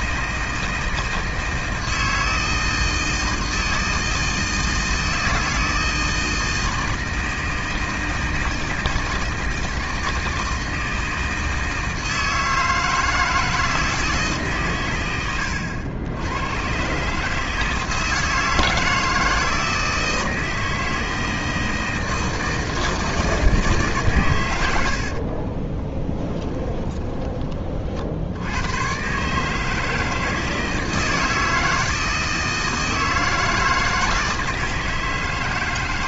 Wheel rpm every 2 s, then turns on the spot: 160, 160, 160, 160, 160, 160, 160, 110, 130, 160, 160, 160, 70, 20, 120, 160, 160, 160.
24-28